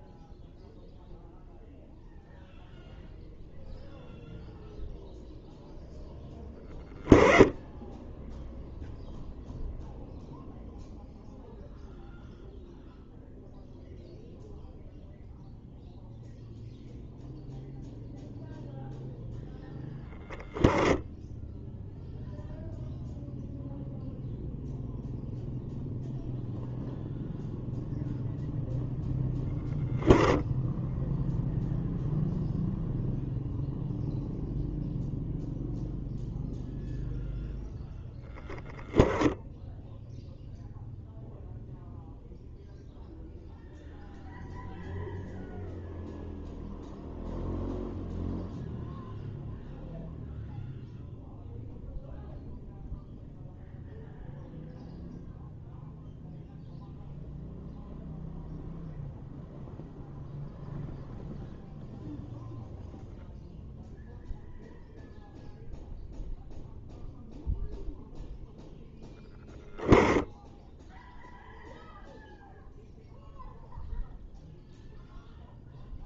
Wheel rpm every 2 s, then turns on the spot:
0, 0, 0, 10, 0, 0, 0, 0, 0, 0, 10, 0, 0, 0, 0, 0, 0, 0, 0, 0, 0, 0, 0, 0, 0, 0, 0, 0, 0, 0, 0, 0, 0, 0, 0, 0, 0, 0.
none